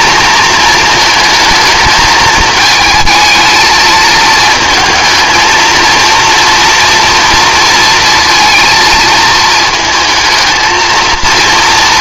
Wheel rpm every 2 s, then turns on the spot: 230, 220, 230, 230, 230, 220.
none